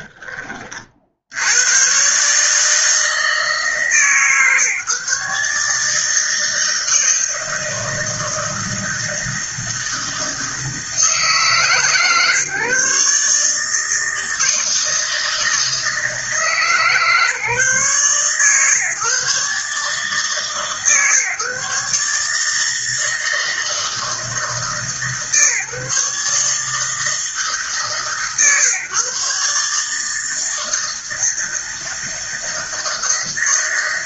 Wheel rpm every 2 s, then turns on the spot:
50, 160, 140, 160, 160, 160, 140, 160, 150, 140, 140, 160, 150, 160, 130, 160, 160.
none